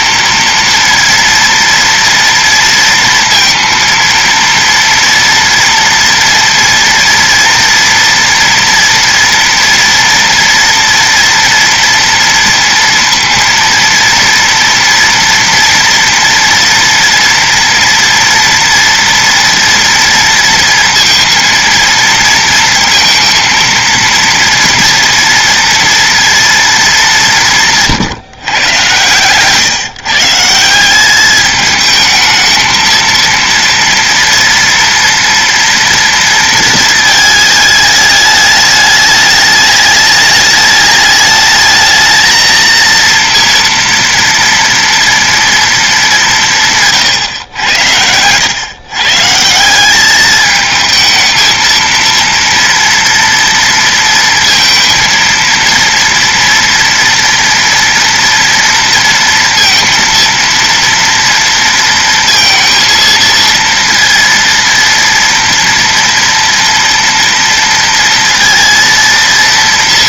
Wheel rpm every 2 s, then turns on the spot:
230, 230, 230, 230, 240, 230, 230, 230, 230, 230, 230, 230, 230, 220, 130, 180, 220, 230, 230, 210, 210, 230, 230, 170, 120, 220, 230, 230, 230, 230, 230, 230, 230, 230, 230.
none